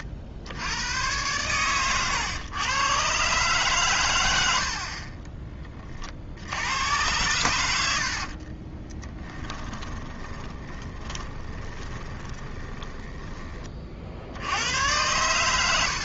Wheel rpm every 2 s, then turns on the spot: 100, 120, 60, 90, 20, 30, 10, 90.
8-14